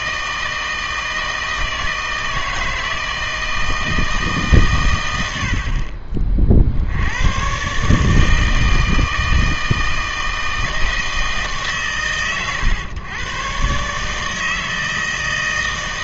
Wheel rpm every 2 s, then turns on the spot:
160, 160, 140, 60, 160, 160, 120, 160.
none